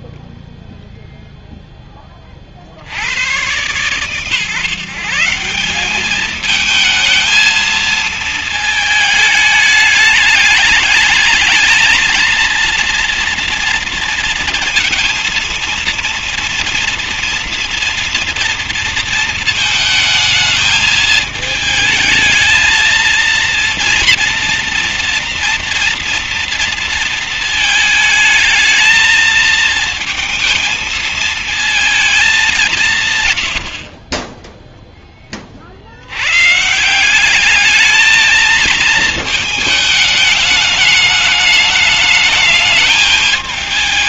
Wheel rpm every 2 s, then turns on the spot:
0, 40, 140, 220, 220, 210, 230, 230, 230, 230, 220, 220, 240, 230, 220, 230, 200, 20, 130, 220, 210, 210.
none